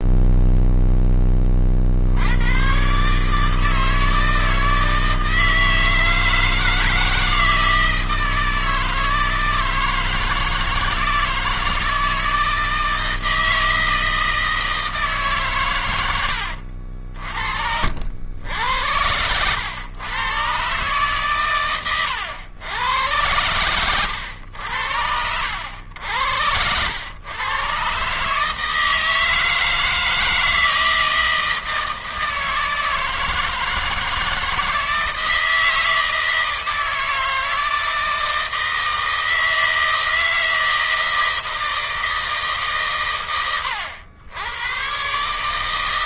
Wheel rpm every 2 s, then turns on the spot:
20, 140, 160, 160, 160, 160, 160, 150, 60, 90, 120, 100, 90, 100, 160, 160, 160, 160, 160, 160, 160, 120, 120.
none